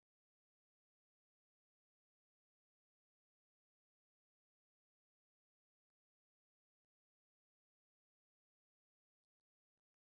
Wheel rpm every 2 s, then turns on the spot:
0, 0, 0, 0, 0.
none